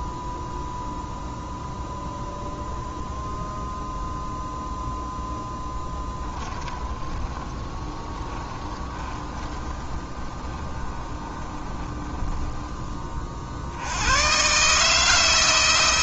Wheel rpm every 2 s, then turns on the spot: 0, 0, 0, 20, 20, 20, 20, 150.
6-12